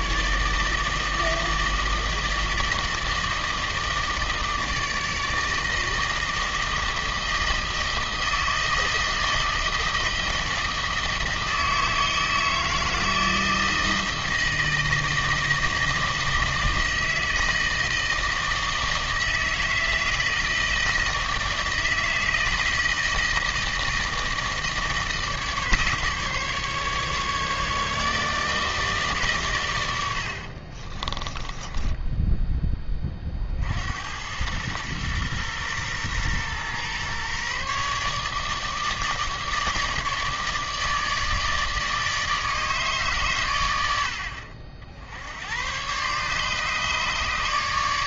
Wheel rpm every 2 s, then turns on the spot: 150, 160, 160, 160, 160, 160, 160, 160, 160, 160, 160, 170, 160, 140, 150, 40, 20, 110, 120, 150, 150, 140, 60, 150.
30-32